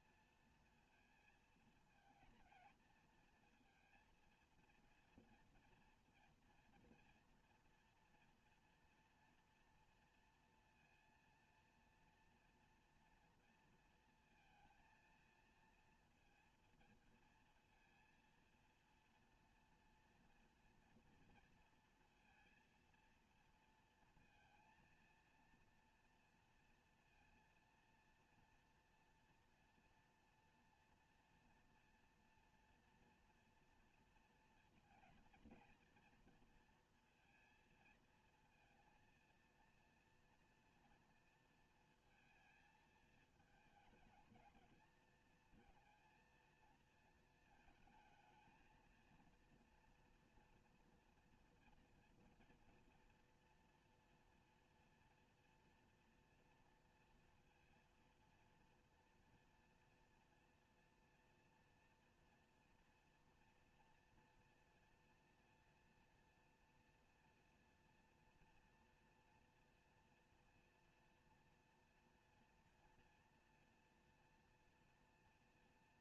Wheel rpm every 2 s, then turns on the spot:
230, 230, 230, 230, 230, 230, 230, 230, 230, 230, 230, 230, 230, 230, 230, 240, 240, 230, 230, 230, 230, 220, 220, 230, 230, 230, 230, 230, 230, 230, 230, 230, 240, 240, 240, 230, 230, 230.
none